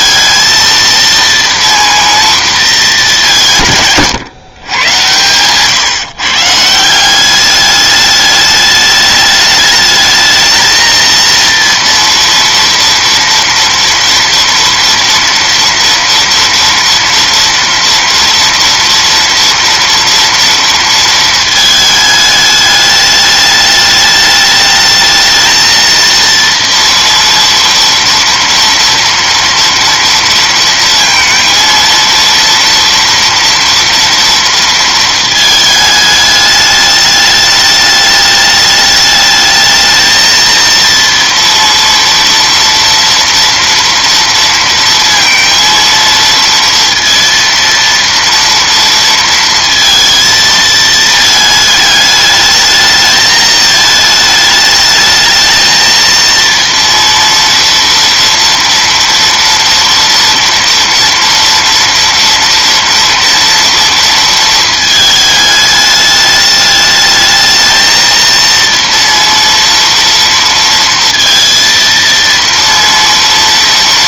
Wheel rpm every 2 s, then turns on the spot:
230, 230, 120, 150, 210, 220, 230, 230, 230, 230, 230, 210, 210, 230, 240, 230, 230, 230, 210, 210, 230, 230, 230, 230, 230, 230, 210, 210, 230, 230, 230, 230, 220, 210, 230, 230, 230.
none